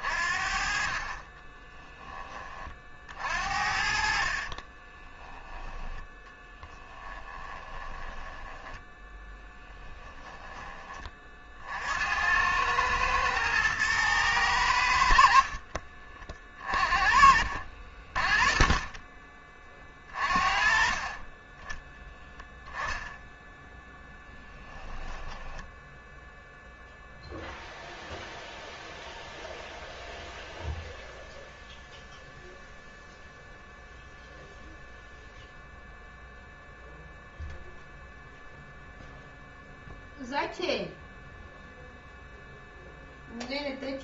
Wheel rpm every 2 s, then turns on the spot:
50, 30, 30, 10, 10, 10, 100, 90, 40, 30, 40, 0, 10, 0, 0, 0, 0, 0, 0, 0, 0, 0.
4-10 16-18 24-26